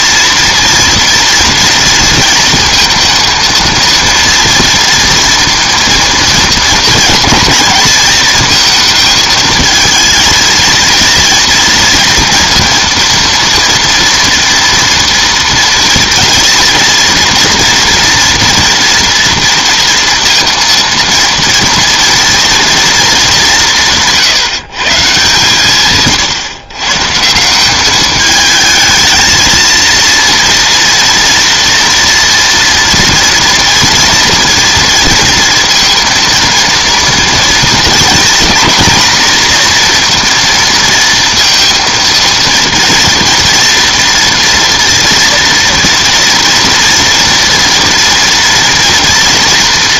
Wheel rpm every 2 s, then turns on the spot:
230, 230, 230, 220, 220, 230, 230, 230, 230, 230, 230, 230, 150, 140, 220, 230, 230, 230, 230, 240, 230, 230, 230, 230, 230.
none